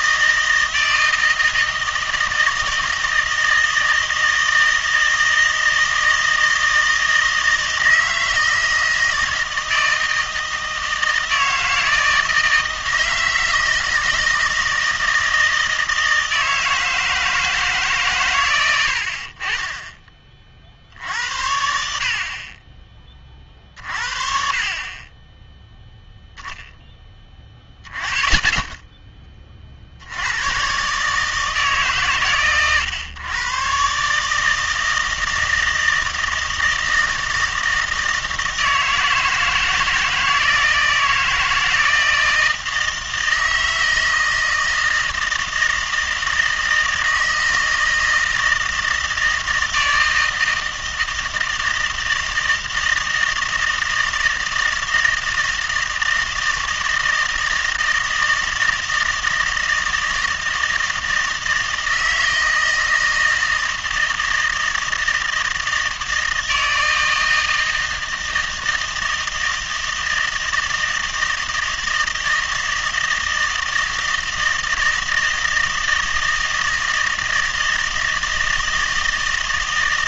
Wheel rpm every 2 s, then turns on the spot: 160, 160, 160, 160, 160, 160, 160, 160, 160, 80, 60, 20, 30, 10, 10, 130, 120, 160, 160, 160, 160, 160, 160, 160, 160, 160, 160, 160, 160, 160, 160, 160, 160, 160, 160, 160, 160, 160, 160, 160.
none